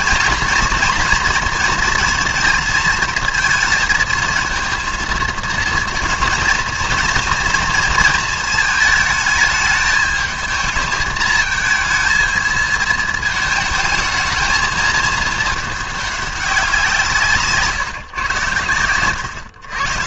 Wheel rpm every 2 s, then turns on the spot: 230, 220, 230, 230, 220, 220, 220, 220, 180, 110.
none